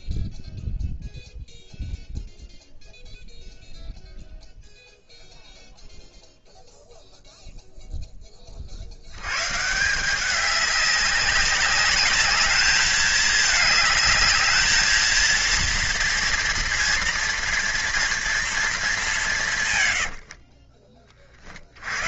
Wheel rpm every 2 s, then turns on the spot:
0, 0, 0, 0, 60, 200, 210, 230, 230, 200, 30.
none